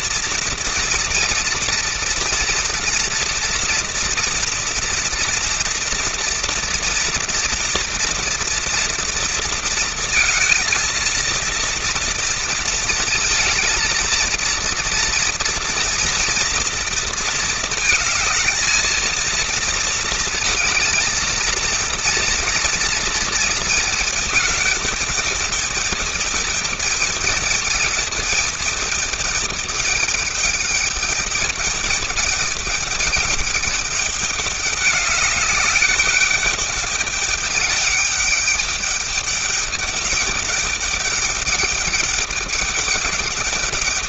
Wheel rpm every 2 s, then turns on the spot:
230, 230, 240, 230, 230, 230, 230, 230, 230, 220, 220, 230, 220, 220, 220, 210, 210, 200, 200, 210, 200, 210.
none